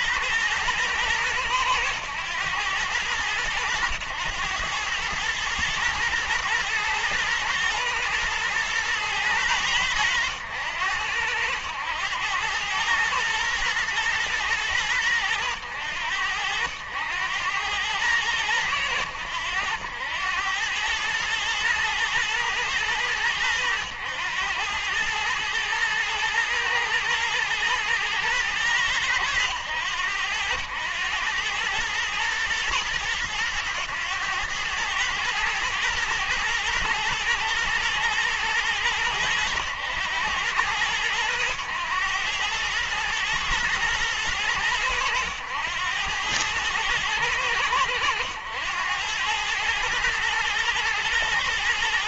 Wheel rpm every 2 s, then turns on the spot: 110, 100, 110, 120, 110, 90, 110, 100, 80, 100, 110, 110, 100, 110, 100, 100, 110, 110, 120, 110, 100, 110, 100, 100, 90, 110.
none